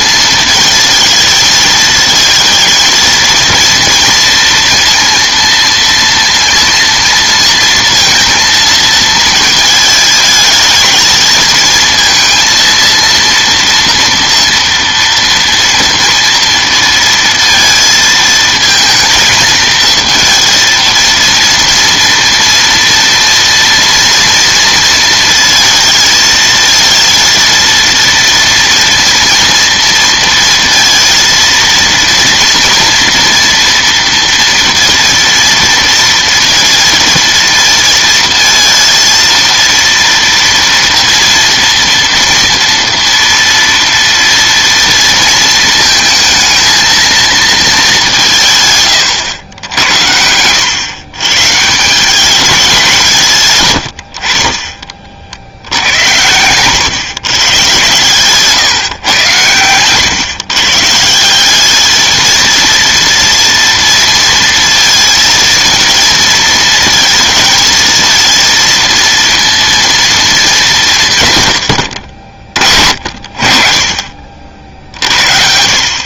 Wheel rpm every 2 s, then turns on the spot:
220, 230, 230, 230, 230, 220, 230, 230, 230, 230, 230, 230, 230, 220, 230, 230, 230, 230, 230, 230, 230, 230, 230, 220, 130, 120, 190, 30, 110, 140, 140, 230, 230, 220, 230, 190, 50, 60.
none